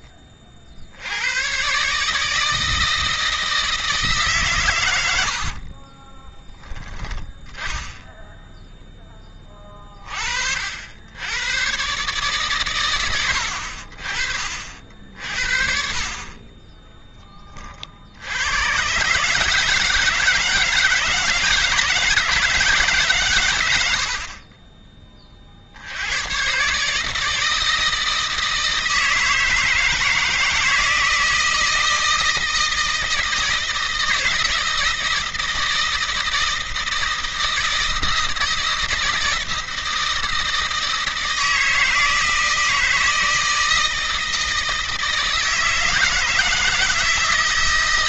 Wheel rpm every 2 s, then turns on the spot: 60, 160, 120, 10, 10, 60, 120, 40, 30, 110, 160, 160, 40, 140, 160, 160, 160, 160, 160, 160, 160, 160, 160, 160.
none